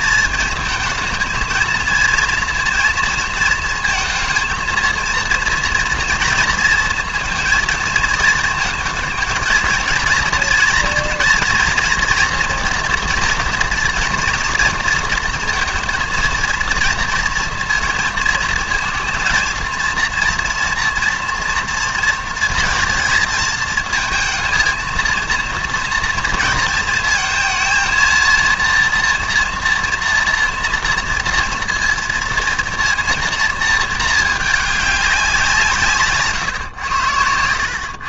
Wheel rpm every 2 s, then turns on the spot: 220, 230, 230, 230, 220, 230, 240, 230, 230, 230, 230, 220, 230, 220, 230, 230, 230, 210, 120.
none